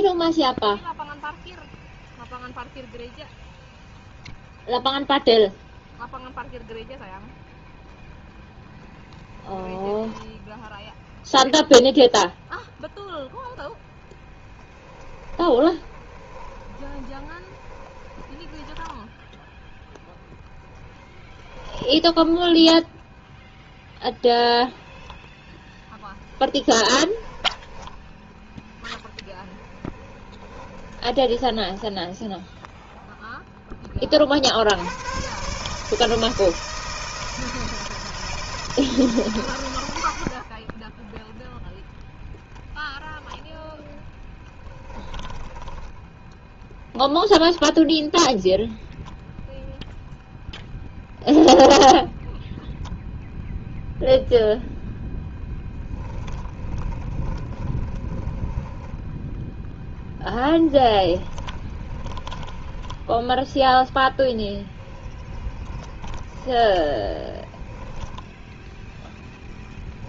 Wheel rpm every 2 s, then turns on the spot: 0, 0, 0, 0, 0, 0, 0, 30, 30, 10, 10, 10, 0, 10, 10, 20, 0, 70, 160, 150, 20, 10, 10, 0, 0, 0, 0, 10, 20, 10, 10, 10, 20, 10, 0.
14-24 26-32 44-46 56-68